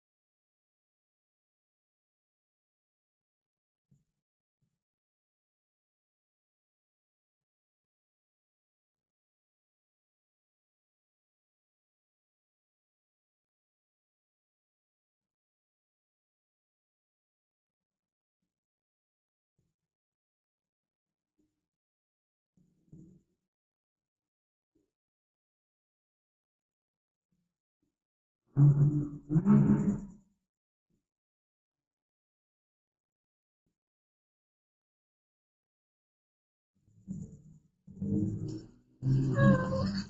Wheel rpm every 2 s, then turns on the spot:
0, 0, 0, 0, 0, 0, 0, 0, 0, 0, 0, 0, 0, 0, 0, 0, 0, 0, 0, 0.
none